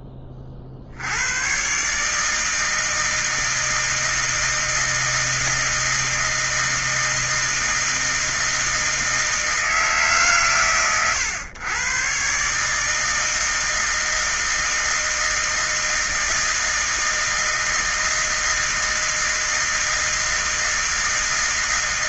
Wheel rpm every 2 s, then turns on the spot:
20, 160, 160, 160, 160, 120, 140, 160, 160, 160, 160.
none